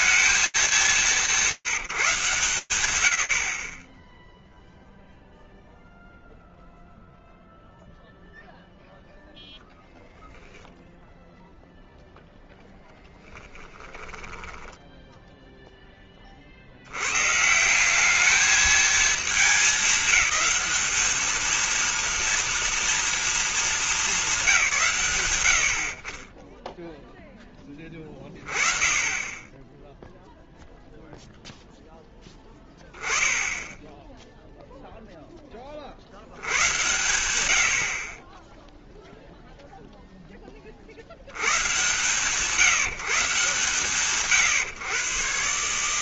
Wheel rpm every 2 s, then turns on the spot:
180, 110, 0, 0, 0, 0, 10, 10, 120, 220, 220, 230, 120, 0, 20, 0, 10, 10, 100, 0, 80, 150, 130.
12-16